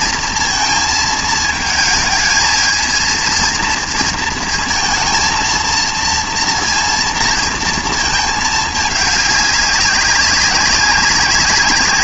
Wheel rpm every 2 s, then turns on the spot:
230, 220, 230, 230, 210, 200.
none